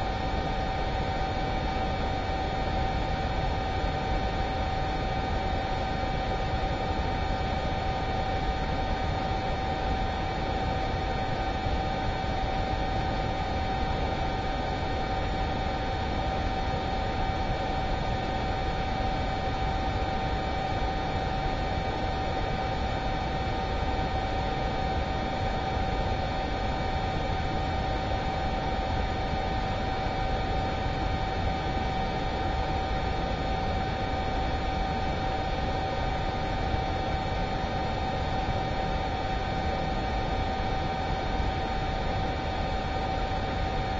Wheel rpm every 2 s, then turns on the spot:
0, 0, 0, 0, 0, 0, 0, 0, 0, 0, 0, 0, 0, 0, 0, 0, 0, 0, 0, 0, 0, 0.
none